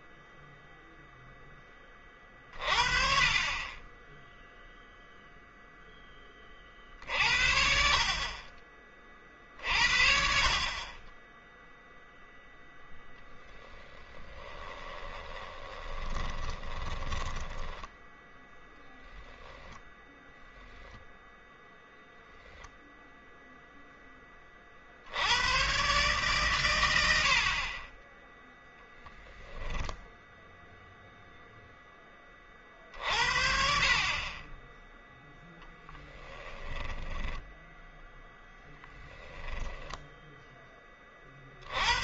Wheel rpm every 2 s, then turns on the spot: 0, 30, 0, 40, 30, 40, 10, 20, 20, 0, 0, 0, 50, 120, 0, 0, 40, 10, 10, 10, 10.
14-18 36-40